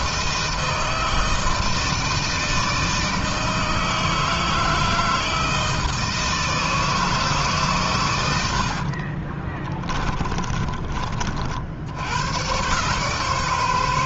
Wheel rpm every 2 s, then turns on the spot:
160, 160, 160, 160, 70, 30, 130.
8-12